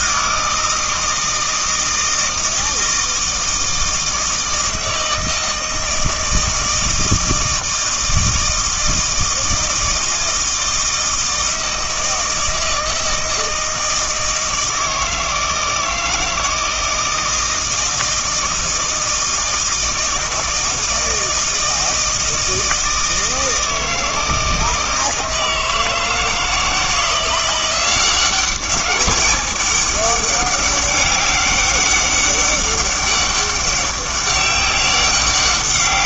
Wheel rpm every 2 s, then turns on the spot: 160, 160, 160, 160, 160, 160, 160, 160, 160, 160, 160, 160, 160, 160, 190, 200, 200, 200.
none